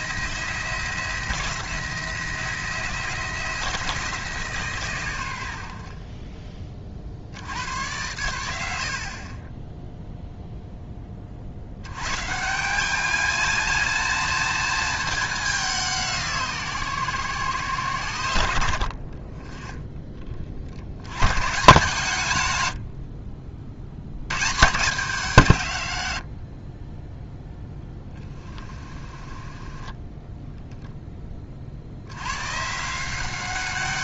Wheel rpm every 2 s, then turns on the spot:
170, 170, 140, 30, 70, 10, 200, 220, 140, 80, 60, 80, 160, 30, 20, 10, 150.
28-30